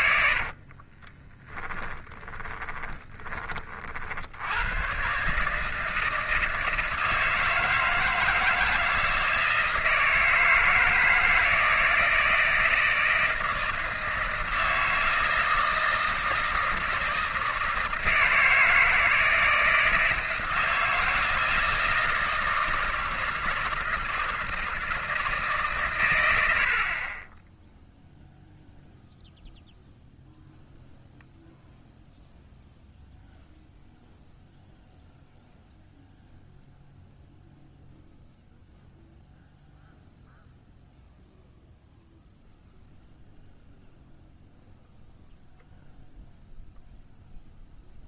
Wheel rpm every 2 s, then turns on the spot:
50, 10, 100, 160, 160, 160, 160, 160, 160, 160, 170, 160, 160, 80, 0, 0, 0, 0, 0, 0, 0, 0, 0, 0.
0-4